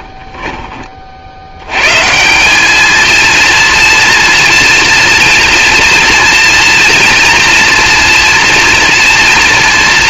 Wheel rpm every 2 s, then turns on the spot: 40, 210, 240, 240, 240.
none